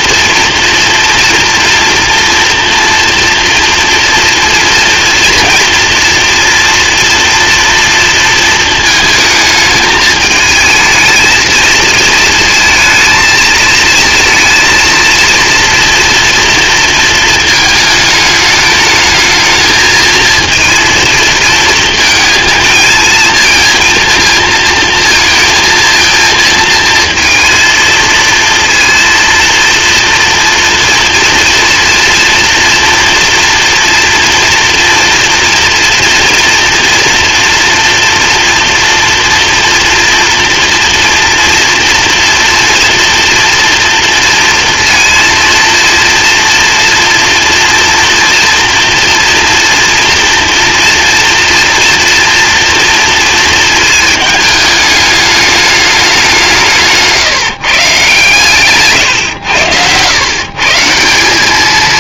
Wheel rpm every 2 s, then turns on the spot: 240, 230, 230, 230, 220, 220, 220, 230, 230, 220, 230, 230, 230, 230, 230, 230, 230, 240, 230, 230, 230, 230, 230, 240, 230, 230, 230, 210, 170, 140, 150.
none